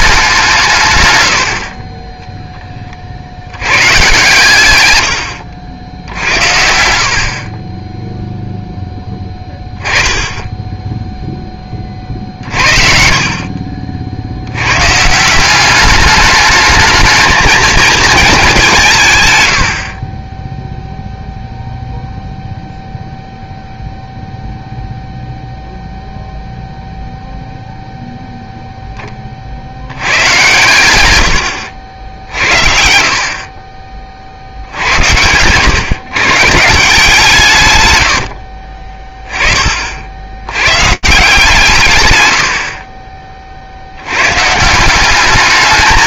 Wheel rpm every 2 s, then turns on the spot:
140, 20, 110, 70, 10, 10, 40, 110, 210, 180, 0, 0, 0, 0, 0, 110, 60, 90, 160, 40, 170, 40, 170.
none